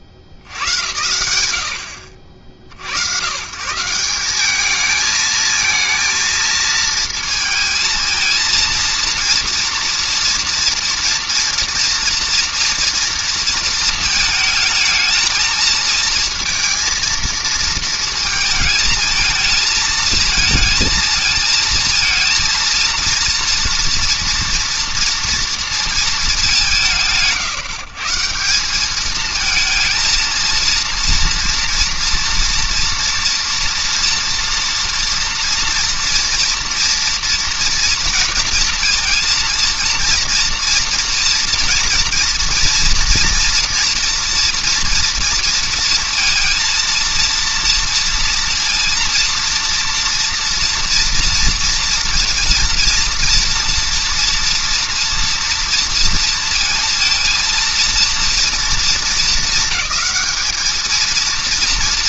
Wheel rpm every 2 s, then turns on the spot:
60, 60, 200, 230, 230, 230, 230, 220, 230, 230, 220, 230, 230, 200, 180, 230, 230, 230, 230, 230, 230, 230, 230, 230, 230, 230, 230, 230, 230, 230, 210.
none